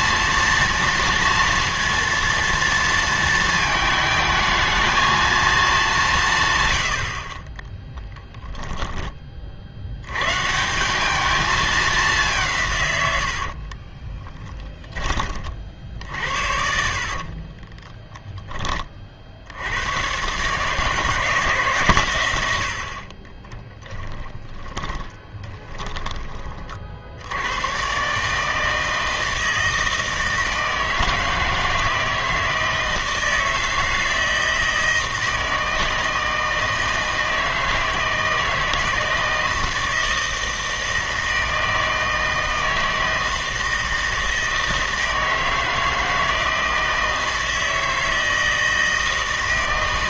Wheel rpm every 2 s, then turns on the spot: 230, 230, 220, 110, 10, 160, 150, 10, 50, 20, 140, 90, 20, 40, 160, 160, 160, 160, 160, 160, 160, 160, 160, 160, 160.
8-10 14-18 24-26